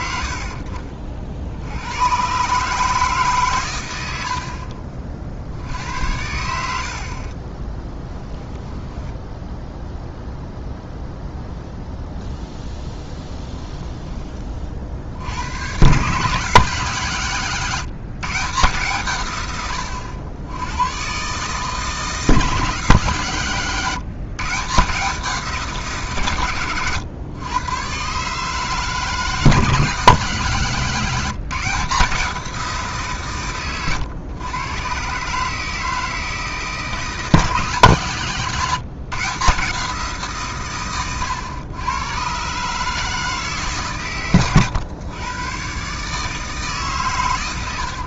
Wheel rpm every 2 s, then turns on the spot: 60, 150, 50, 60, 10, 0, 0, 50, 160, 160, 110, 160, 160, 120, 160, 170, 170, 130, 160, 160, 130, 150, 110, 150.
4-6 8-10